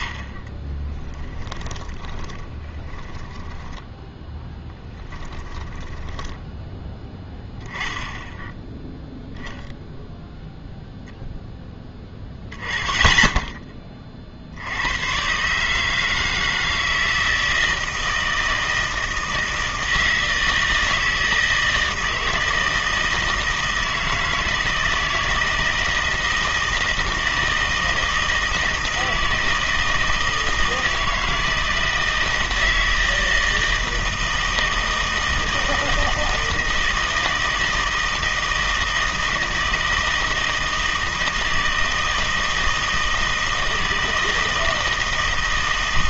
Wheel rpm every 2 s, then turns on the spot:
30, 10, 10, 20, 10, 0, 20, 90, 160, 160, 160, 160, 160, 160, 160, 160, 160, 160, 160, 160, 160, 160, 160.
0-6